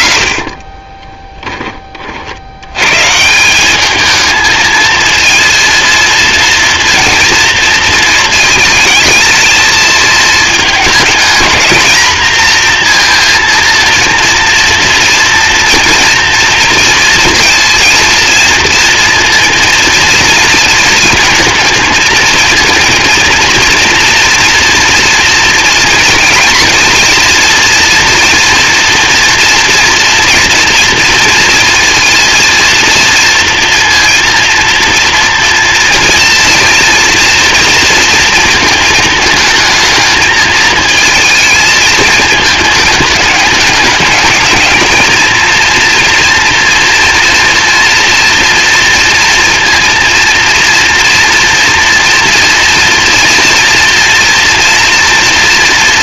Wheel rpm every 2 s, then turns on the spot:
40, 90, 220, 230, 220, 220, 230, 230, 230, 230, 230, 230, 230, 230, 240, 230, 230, 230, 230, 220, 220, 220, 210, 230, 230, 230, 230, 240.
0-2